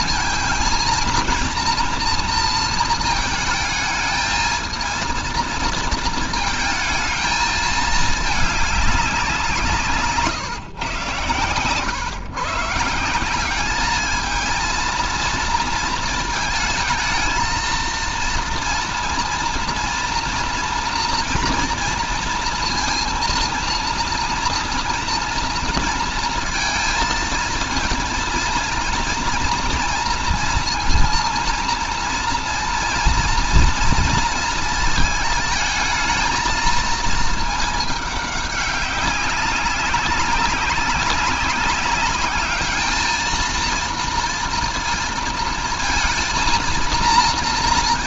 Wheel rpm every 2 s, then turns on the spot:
230, 230, 220, 220, 200, 130, 150, 230, 220, 230, 230, 230, 230, 220, 230, 230, 230, 230, 230, 200, 200, 220, 230, 230.
none